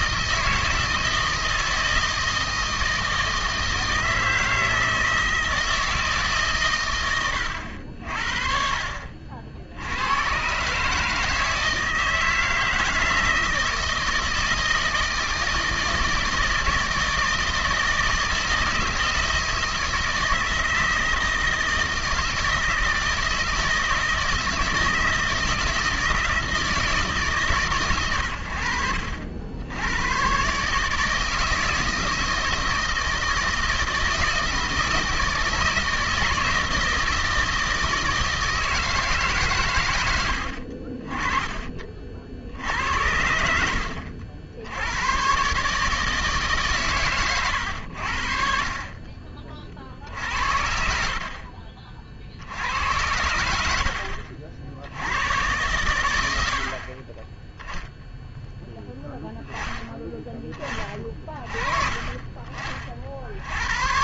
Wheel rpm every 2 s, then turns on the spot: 160, 160, 160, 140, 50, 120, 160, 160, 160, 160, 160, 160, 160, 160, 100, 130, 160, 160, 160, 160, 70, 80, 70, 140, 50, 60, 70, 60, 70, 0, 20, 30.
none